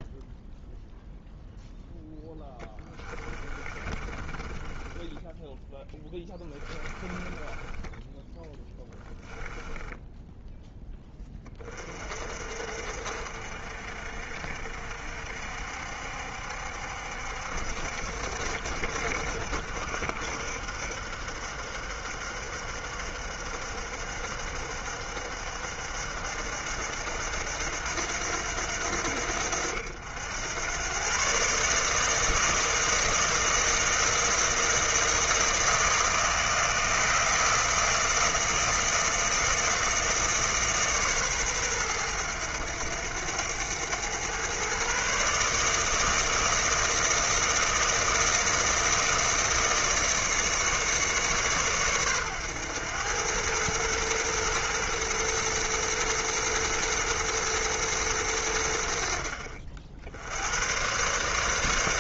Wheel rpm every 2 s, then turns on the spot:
0, 10, 10, 20, 10, 10, 50, 60, 70, 60, 70, 60, 70, 80, 80, 110, 160, 160, 160, 160, 140, 90, 130, 160, 160, 150, 110, 120, 110, 80, 120.
2-10